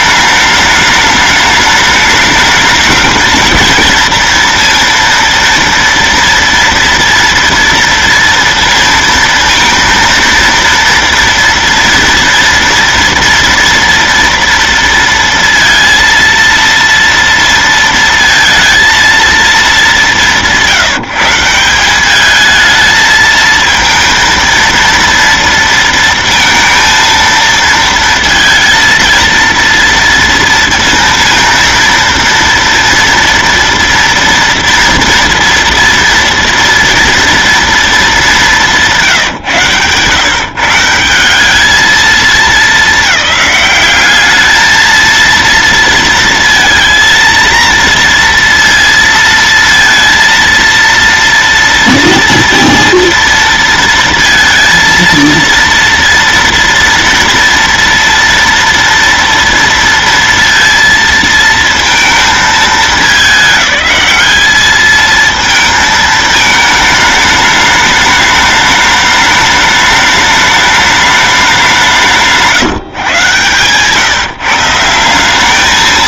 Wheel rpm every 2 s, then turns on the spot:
210, 210, 230, 230, 230, 230, 230, 230, 230, 230, 160, 220, 230, 230, 230, 230, 230, 230, 230, 180, 150, 210, 220, 230, 230, 230, 230, 230, 230, 230, 230, 210, 220, 220, 210, 210, 150, 150.
none